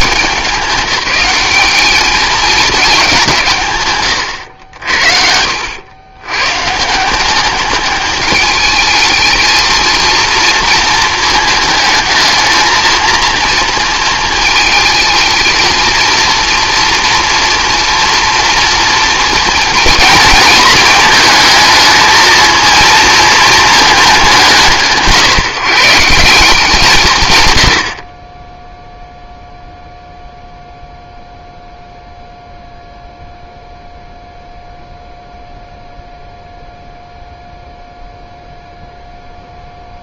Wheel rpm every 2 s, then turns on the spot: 190, 220, 80, 150, 220, 230, 230, 220, 230, 230, 220, 230, 170, 170, 10, 0, 0, 0, 0, 0.
none